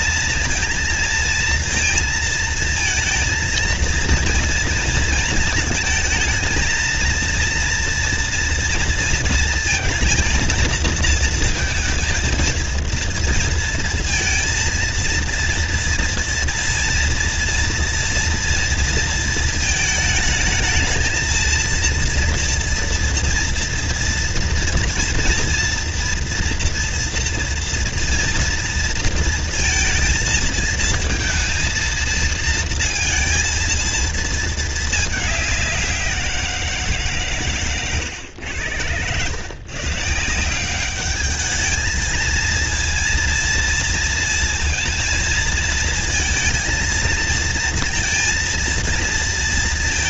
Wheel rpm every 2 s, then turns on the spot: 230, 230, 230, 220, 230, 230, 220, 230, 230, 230, 220, 230, 230, 230, 230, 230, 230, 220, 180, 100, 170, 230, 230, 230, 230.
none